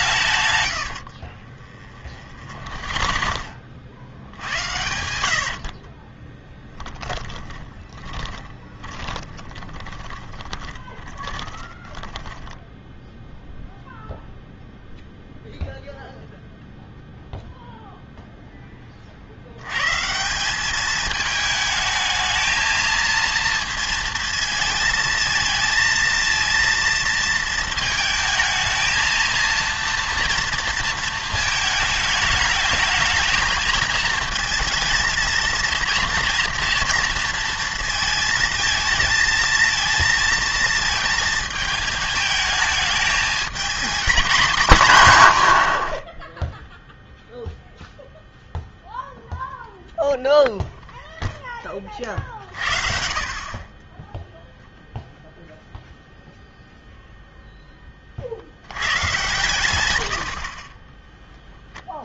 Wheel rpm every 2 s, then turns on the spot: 100, 50, 80, 10, 20, 20, 10, 0, 0, 10, 200, 220, 220, 230, 220, 230, 220, 220, 230, 220, 220, 220, 200, 0, 0, 0, 50, 0, 0, 80, 30.
0-12